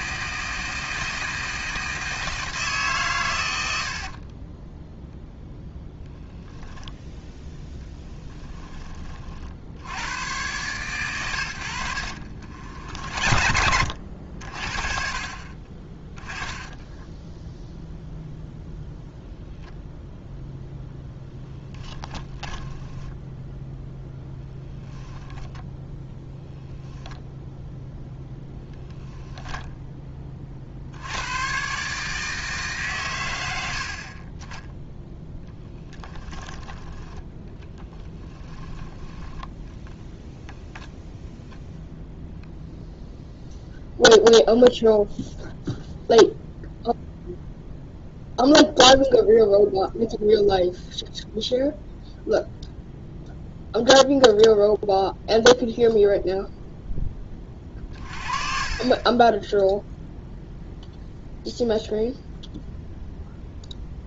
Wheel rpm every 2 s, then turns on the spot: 160, 150, 10, 10, 20, 110, 50, 50, 10, 0, 0, 10, 10, 0, 0, 60, 140, 10, 10, 10, 0, 0, 0, 0, 0, 0, 0, 0, 0, 30, 0, 0.
4-6 12-14 22-24